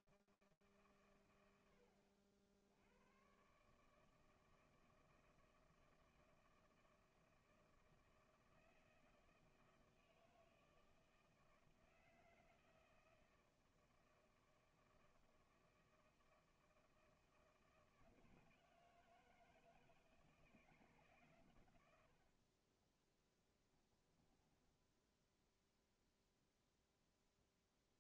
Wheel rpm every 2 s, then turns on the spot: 90, 160, 160, 160, 160, 160, 160, 160, 160, 160, 80, 10, 0, 0.
22-24